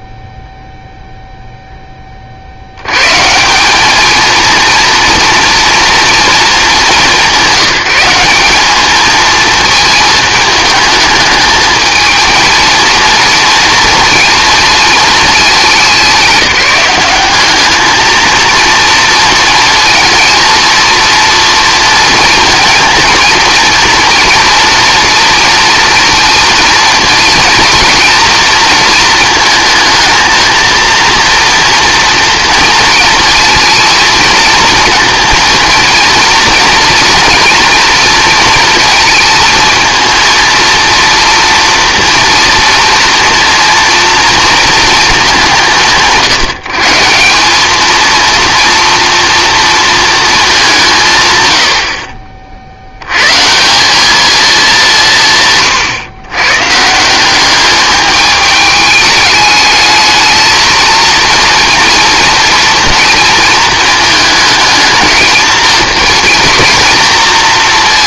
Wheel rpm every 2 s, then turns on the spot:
0, 80, 230, 210, 210, 220, 230, 230, 190, 230, 230, 230, 230, 230, 230, 230, 240, 230, 230, 230, 230, 230, 230, 150, 230, 190, 60, 200, 140, 210, 230, 230, 220, 230.
none